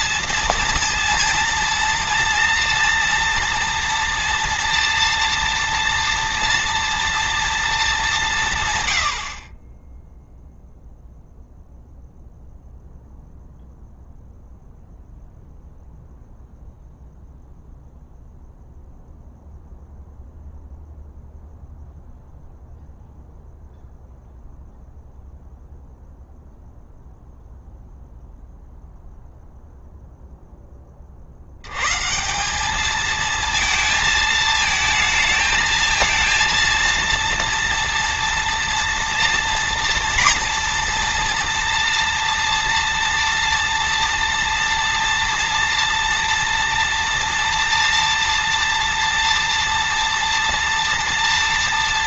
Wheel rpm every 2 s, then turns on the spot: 230, 230, 230, 230, 130, 0, 0, 0, 0, 0, 0, 0, 0, 0, 0, 20, 210, 220, 230, 230, 230, 230, 230, 230, 230, 230.
none